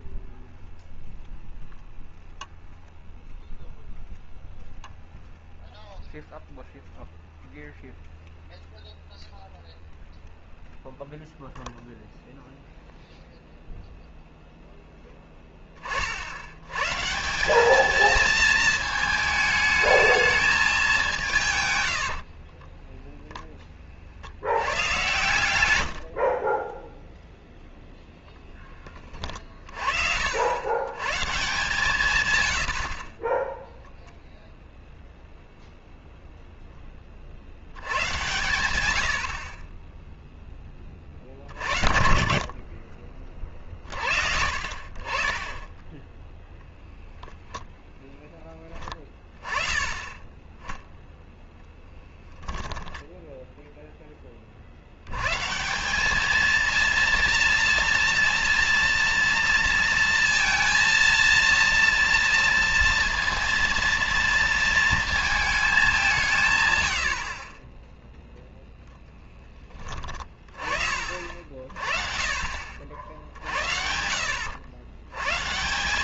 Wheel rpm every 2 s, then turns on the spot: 0, 0, 0, 0, 0, 0, 0, 0, 100, 220, 210, 30, 80, 30, 0, 80, 90, 0, 0, 110, 10, 40, 50, 0, 10, 10, 10, 40, 220, 230, 230, 230, 230, 140, 0, 20, 50, 70.
22-24 26-28